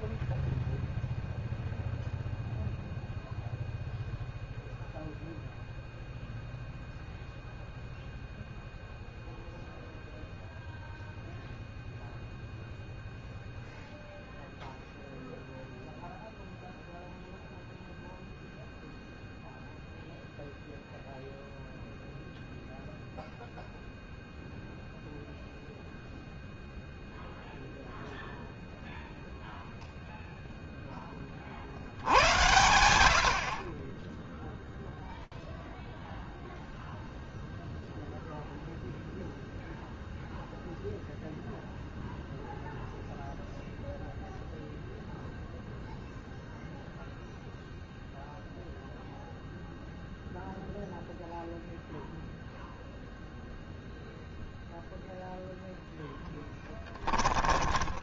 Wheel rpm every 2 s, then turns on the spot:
0, 0, 0, 0, 0, 0, 0, 0, 0, 0, 0, 0, 0, 0, 0, 90, 0, 0, 0, 0, 0, 0, 0, 0, 0, 0, 0, 0, 10.
56-58